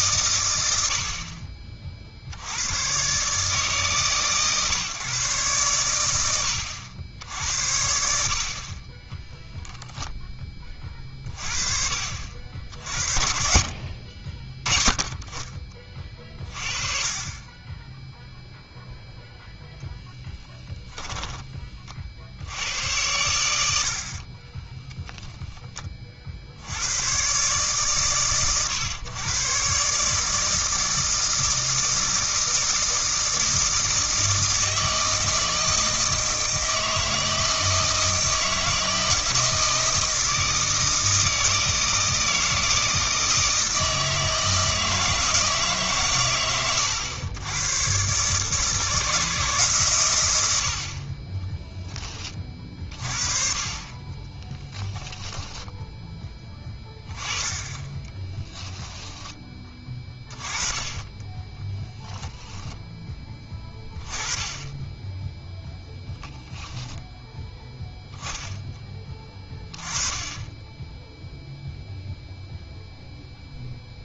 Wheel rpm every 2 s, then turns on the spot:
80, 100, 130, 80, 40, 20, 60, 20, 30, 0, 10, 80, 10, 90, 120, 160, 160, 160, 160, 160, 160, 160, 160, 110, 150, 70, 40, 10, 20, 10, 10, 10, 10, 10, 10, 10, 0.
20-22 24-26 54-56 58-60